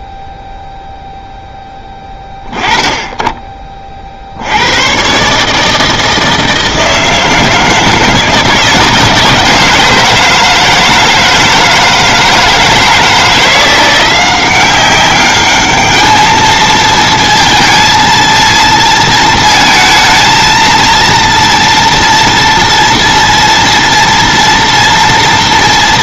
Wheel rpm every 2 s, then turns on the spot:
0, 20, 130, 160, 160, 160, 160, 190, 230, 230, 230, 230, 230.
none